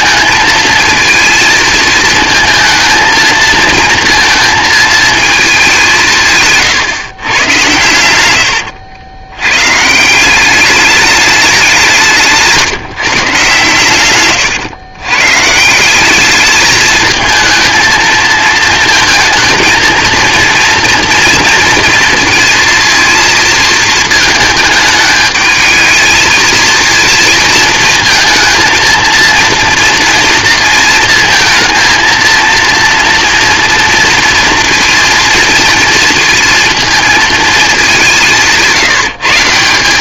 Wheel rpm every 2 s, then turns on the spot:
230, 230, 230, 140, 80, 200, 150, 120, 220, 220, 230, 230, 210, 220, 230, 220, 230, 230, 220, 160.
none